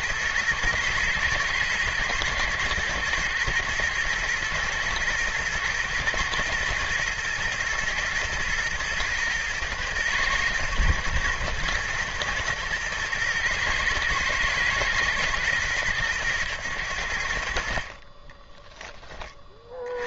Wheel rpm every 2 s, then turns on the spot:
110, 110, 110, 120, 120, 110, 110, 120, 90, 20.
none